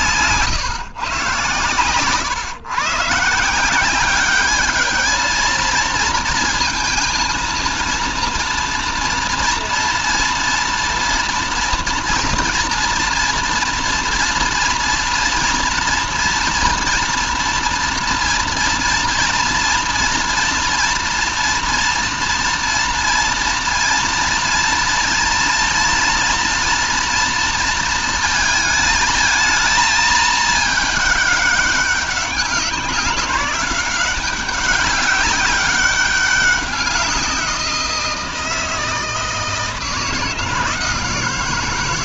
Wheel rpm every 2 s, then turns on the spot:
130, 140, 210, 230, 230, 230, 240, 230, 230, 230, 230, 230, 230, 230, 220, 220, 190, 200, 190, 160, 160.
none